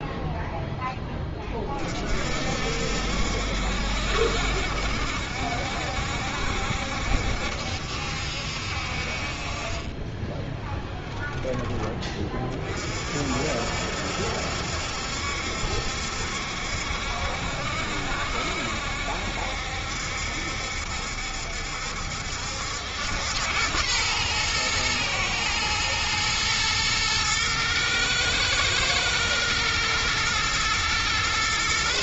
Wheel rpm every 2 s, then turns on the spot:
10, 60, 60, 70, 50, 10, 40, 70, 70, 60, 70, 90, 120, 110, 110, 120.
none